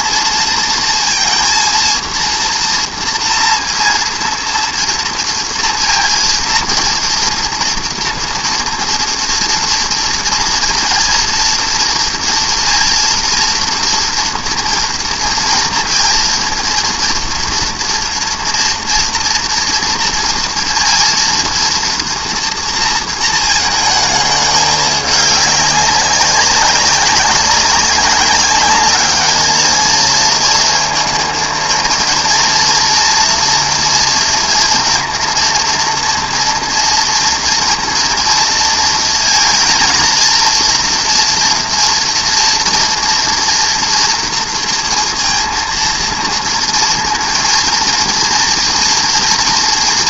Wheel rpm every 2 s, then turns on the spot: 230, 230, 230, 230, 230, 230, 230, 230, 230, 230, 230, 230, 210, 200, 200, 220, 230, 230, 230, 230, 230, 230, 230, 230, 230.
none